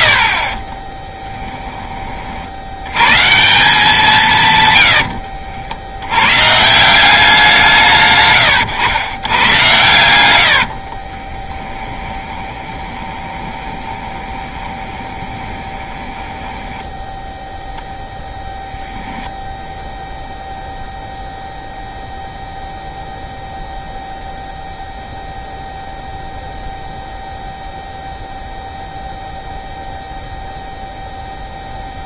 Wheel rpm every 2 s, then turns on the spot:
30, 70, 120, 150, 120, 70, 20, 20, 10, 10, 0, 0, 0, 0, 0, 0.
0-2 10-18